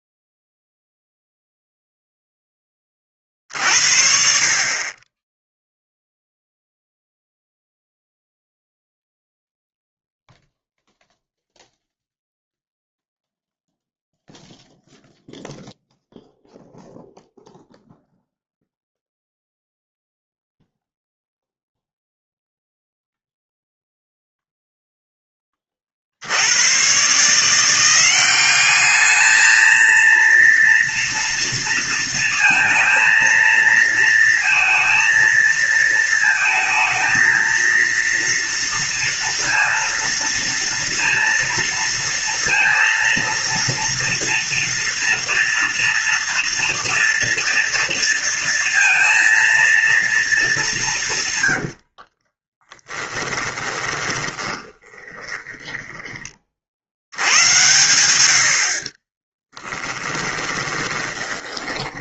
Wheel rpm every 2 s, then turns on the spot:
0, 30, 70, 0, 0, 0, 0, 0, 0, 0, 0, 0, 0, 120, 210, 230, 230, 230, 220, 230, 230, 230, 230, 240, 230, 180, 20, 20, 70, 30, 20.
52-56 60-62